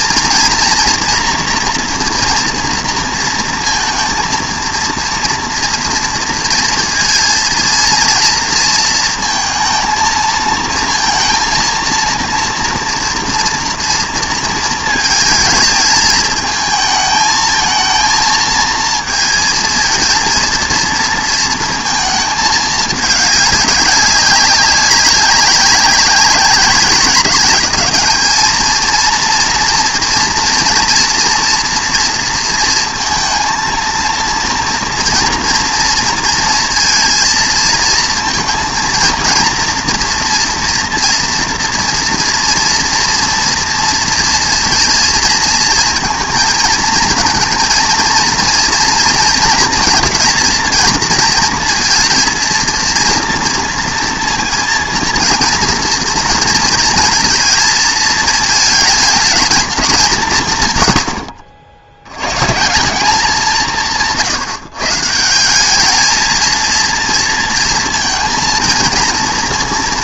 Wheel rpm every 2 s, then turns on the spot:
240, 230, 230, 230, 230, 230, 230, 220, 220, 230, 230, 210, 190, 200, 230, 230, 230, 230, 230, 230, 230, 230, 230, 230, 220, 230, 230, 230, 230, 220, 110, 180, 150, 230, 230.
none